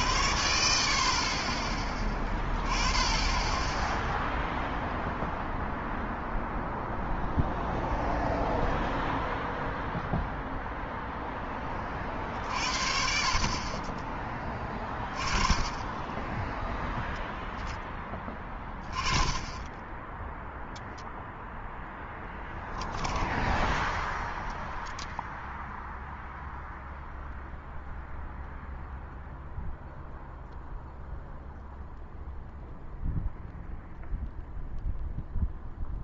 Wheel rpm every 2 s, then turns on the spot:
30, 20, 0, 0, 0, 0, 50, 20, 0, 10, 0, 0, 0, 0, 0, 0, 0, 0.
none